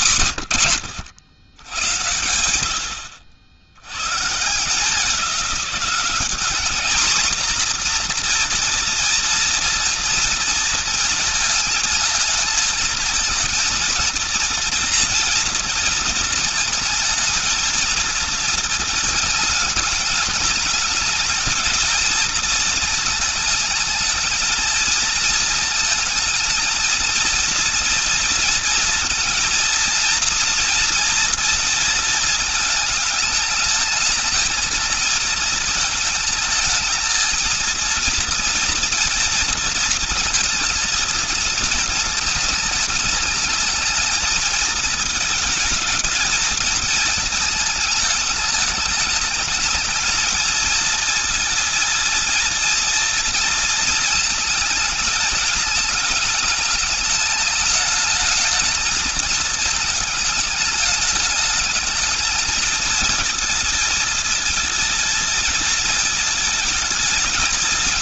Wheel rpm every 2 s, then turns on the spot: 100, 80, 180, 240, 230, 220, 220, 230, 220, 220, 220, 220, 220, 220, 220, 230, 210, 230, 220, 230, 230, 210, 220, 220, 210, 220, 230, 210, 210, 220, 210, 220, 220, 220.
none